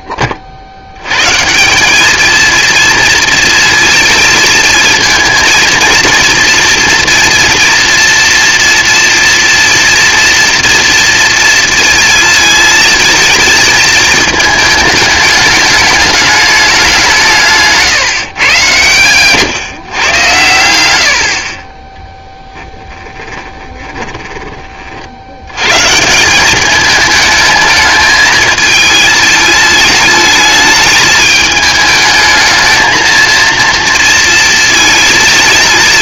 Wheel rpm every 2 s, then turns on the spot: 60, 230, 220, 230, 230, 240, 220, 220, 200, 120, 110, 10, 20, 200, 220, 210, 220, 220.
20-22